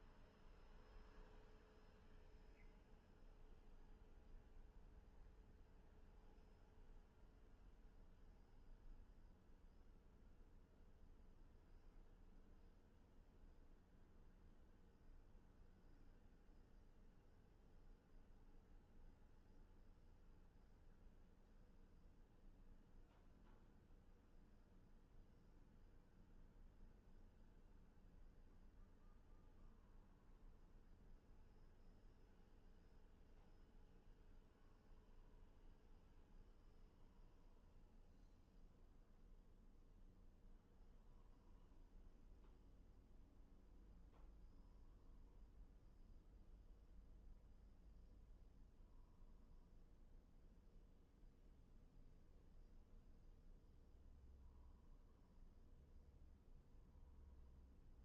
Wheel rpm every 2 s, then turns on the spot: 0, 0, 0, 0, 0, 0, 0, 0, 0, 0, 0, 0, 0, 0, 0, 0, 0, 0, 0, 0, 0, 0, 0, 0, 0, 0, 0, 0, 0.
none